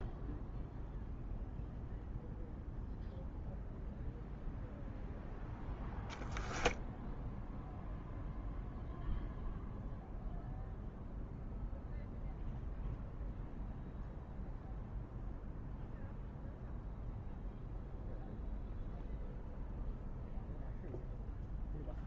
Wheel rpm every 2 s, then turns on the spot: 0, 0, 0, 0, 0, 0, 0, 0, 0, 0, 0.
none